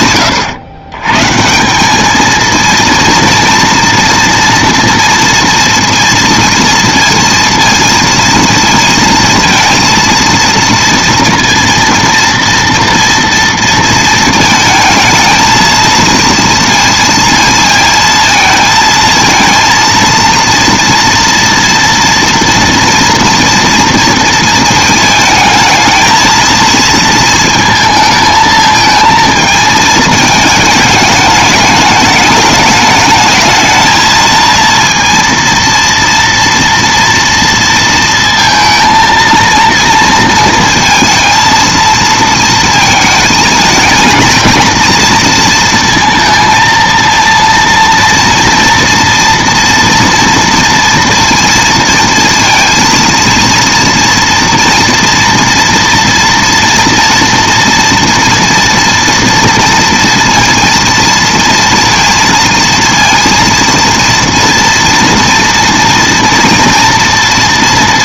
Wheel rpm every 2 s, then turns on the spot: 120, 230, 230, 230, 230, 230, 230, 220, 230, 230, 230, 230, 230, 220, 220, 220, 210, 230, 230, 230, 230, 230, 230, 230, 230, 230, 230, 230, 230, 240, 230, 230, 230, 230.
none